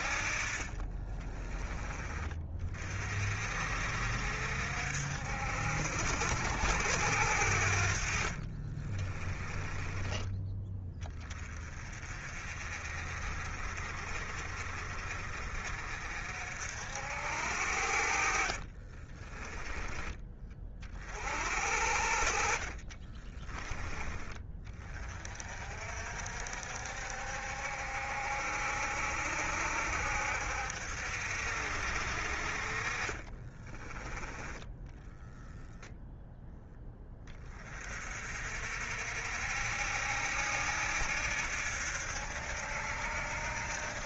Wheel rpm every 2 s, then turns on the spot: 30, 40, 60, 80, 40, 20, 40, 40, 60, 30, 40, 40, 30, 60, 60, 70, 40, 10, 10, 60, 70, 70.
0-2 8-10 18-20 22-24 32-34